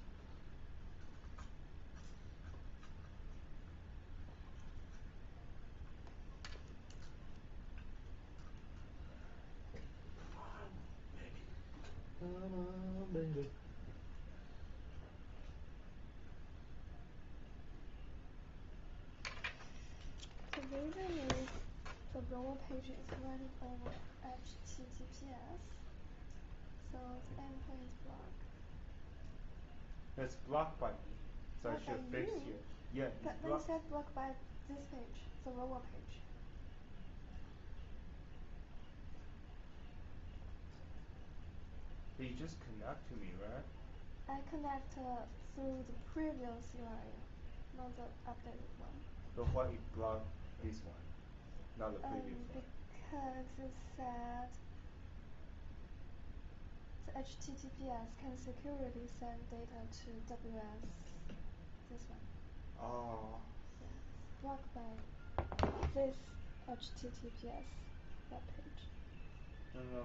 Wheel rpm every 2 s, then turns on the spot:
0, 0, 0, 0, 0, 0, 0, 0, 0, 0, 0, 0, 0, 0, 0, 0, 0, 0, 0, 0, 0, 0, 0, 0, 0, 0, 0, 0, 0, 0, 0, 0, 0, 0, 0.
none